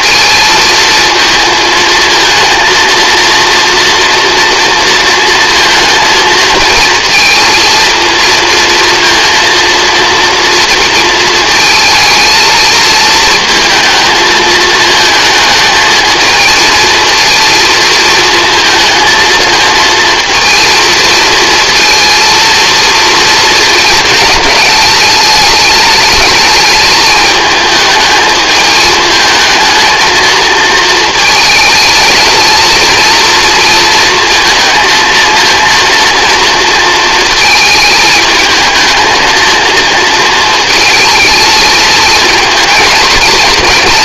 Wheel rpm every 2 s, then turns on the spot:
220, 230, 230, 230, 230, 230, 220, 220, 230, 230, 230, 220, 210, 220, 220, 230, 230, 230, 220, 230, 220, 230.
none